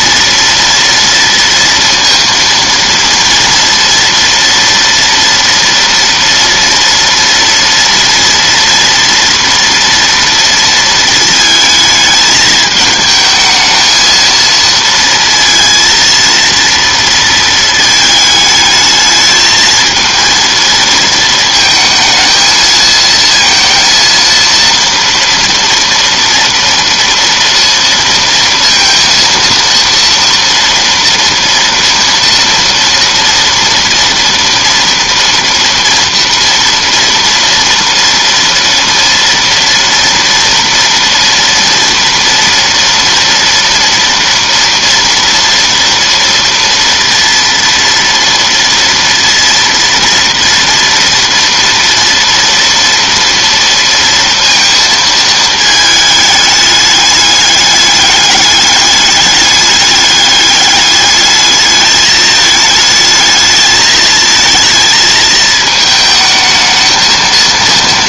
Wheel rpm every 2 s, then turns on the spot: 230, 230, 230, 230, 240, 230, 210, 230, 230, 220, 230, 220, 230, 230, 230, 230, 230, 230, 230, 230, 230, 230, 230, 230, 230, 230, 230, 230, 210, 200, 210, 210, 220, 220.
none